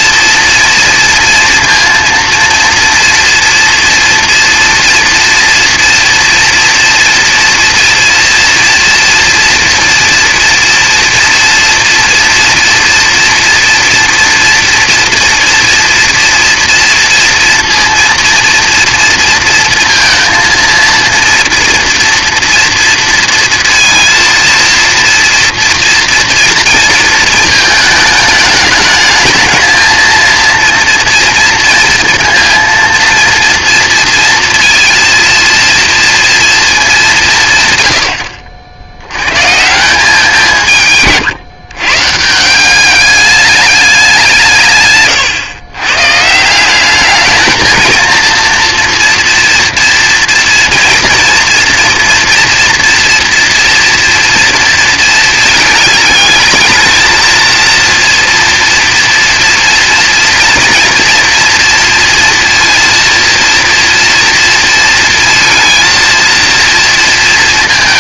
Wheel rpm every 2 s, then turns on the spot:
230, 230, 240, 230, 230, 230, 230, 230, 230, 230, 230, 230, 230, 220, 210, 230, 230, 230, 180, 80, 150, 200, 130, 200, 230, 230, 230, 220, 220, 230, 230, 230, 230, 230.
none